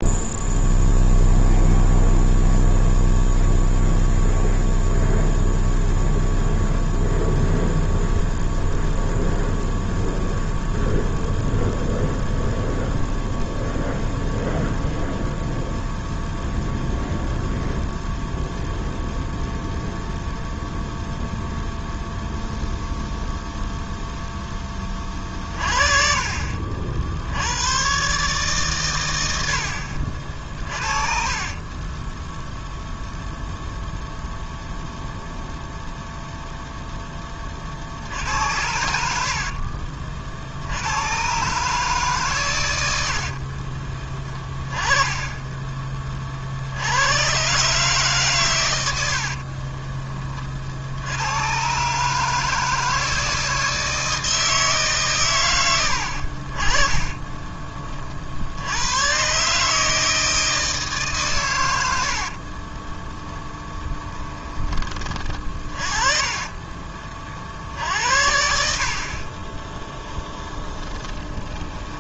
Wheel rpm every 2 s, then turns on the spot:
0, 0, 0, 0, 0, 0, 0, 0, 0, 0, 0, 0, 30, 70, 110, 40, 0, 0, 0, 70, 100, 90, 10, 90, 80, 80, 160, 150, 40, 110, 150, 20, 30, 30, 60, 10.
30-32 42-44 56-58 62-64 70-72